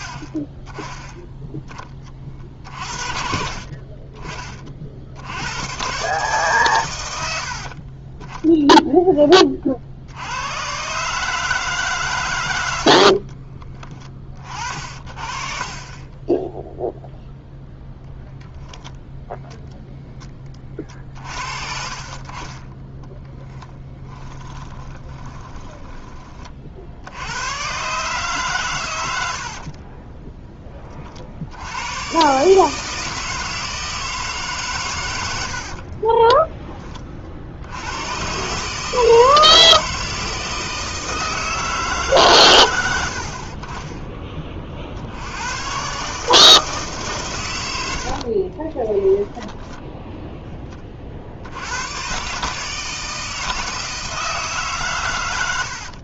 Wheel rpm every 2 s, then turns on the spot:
20, 40, 30, 130, 10, 90, 120, 40, 0, 0, 30, 30, 10, 40, 130, 10, 150, 140, 20, 140, 160, 120, 30, 160, 30, 20, 150, 150.
14-16 22-26 48-50